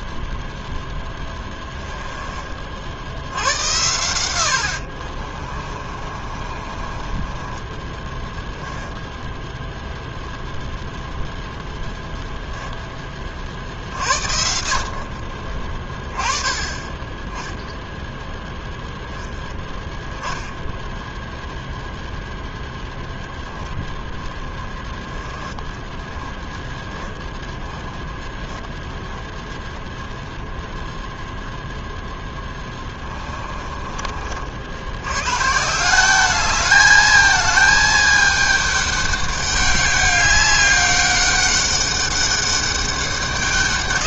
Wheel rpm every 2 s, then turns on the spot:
0, 40, 80, 30, 0, 0, 0, 60, 20, 10, 0, 0, 10, 10, 10, 0, 10, 60, 210, 210, 200, 200.
6-8 32-34